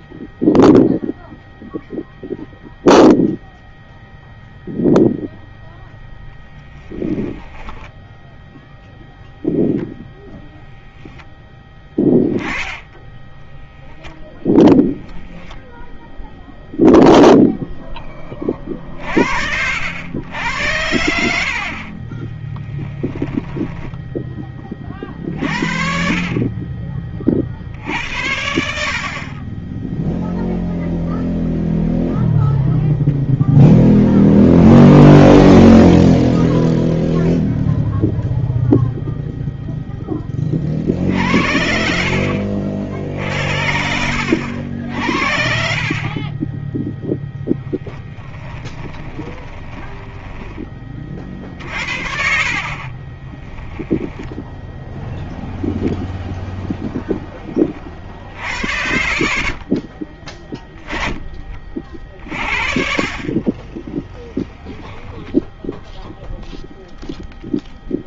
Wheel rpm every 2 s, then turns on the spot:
0, 0, 0, 20, 0, 0, 10, 0, 0, 50, 80, 10, 40, 40, 50, 0, 0, 0, 0, 0, 50, 60, 60, 0, 20, 30, 30, 0, 10, 50, 20, 40, 10, 0.
6-8 20-22 48-50 52-54 58-60